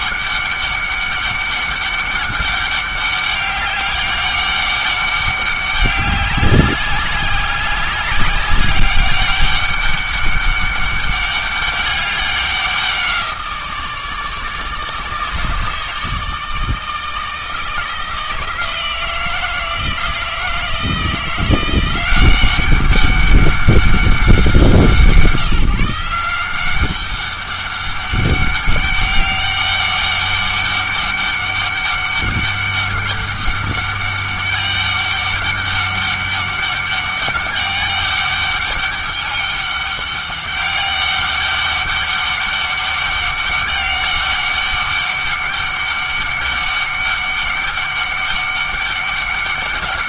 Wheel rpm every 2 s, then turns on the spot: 200, 200, 200, 190, 190, 200, 190, 150, 160, 170, 160, 190, 180, 180, 200, 200, 200, 200, 200, 200, 200, 200, 200, 200, 200.
none